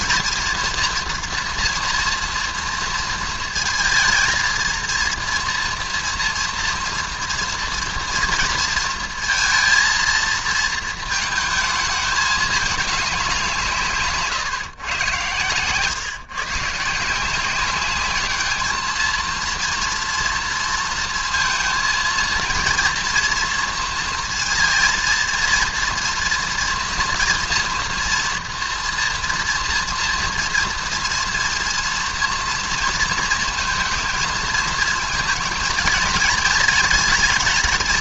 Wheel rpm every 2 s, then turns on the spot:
230, 230, 230, 230, 230, 220, 210, 120, 150, 220, 230, 230, 230, 230, 230, 230, 230, 220, 220.
none